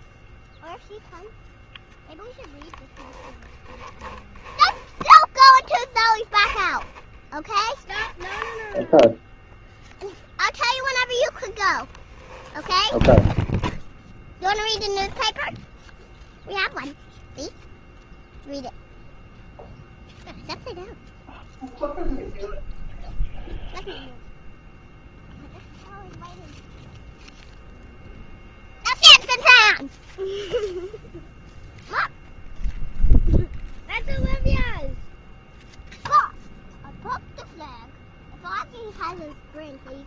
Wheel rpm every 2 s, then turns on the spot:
0, 10, 10, 10, 10, 0, 10, 0, 0, 0, 0, 0, 0, 0, 0, 0, 0, 0, 0, 0.
4-6 8-10 12-14